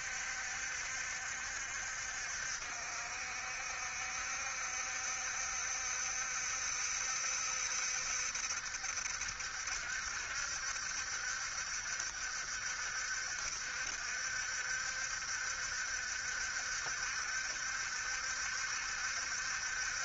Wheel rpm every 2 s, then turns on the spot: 70, 60, 70, 70, 70, 70, 60, 70, 70, 70.
none